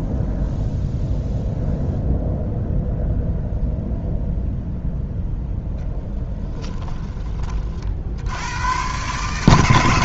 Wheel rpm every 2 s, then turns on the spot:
0, 0, 0, 10, 120.
6-8